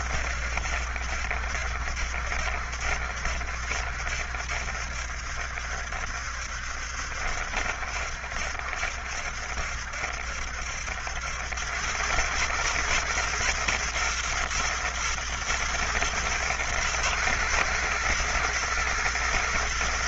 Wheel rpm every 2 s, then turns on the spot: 70, 70, 70, 70, 70, 70, 110, 120, 110, 120.
none